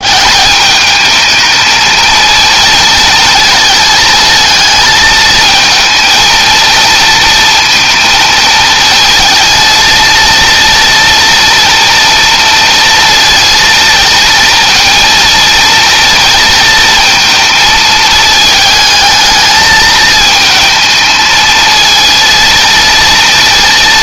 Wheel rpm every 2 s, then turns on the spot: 210, 230, 220, 230, 220, 230, 230, 230, 230, 220, 220, 230.
none